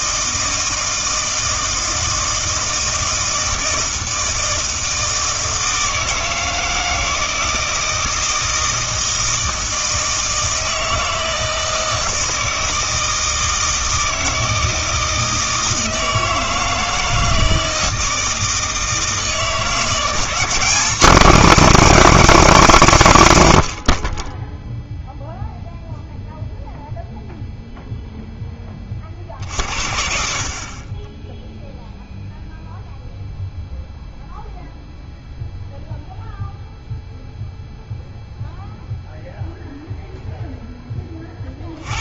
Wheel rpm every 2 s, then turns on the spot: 160, 160, 160, 160, 160, 160, 160, 160, 160, 160, 180, 180, 0, 0, 20, 40, 0, 0, 0, 0, 10.
none